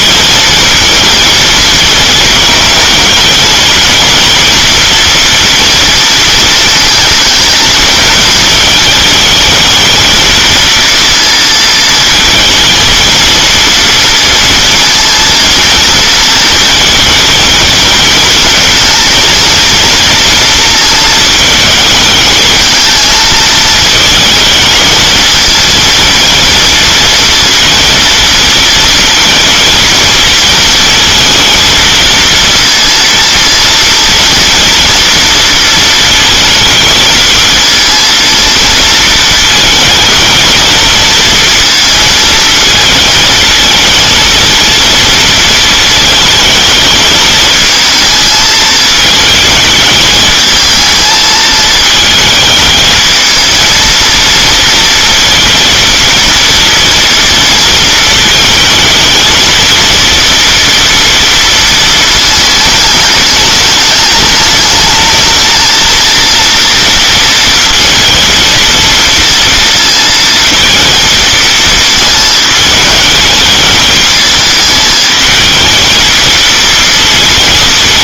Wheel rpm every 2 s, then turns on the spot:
230, 210, 230, 220, 220, 230, 230, 230, 220, 220, 220, 220, 220, 230, 230, 220, 230, 230, 220, 230, 220, 220, 230, 220, 220, 220, 220, 230, 230, 220, 230, 220, 220, 230, 230, 230, 210, 220, 230.
none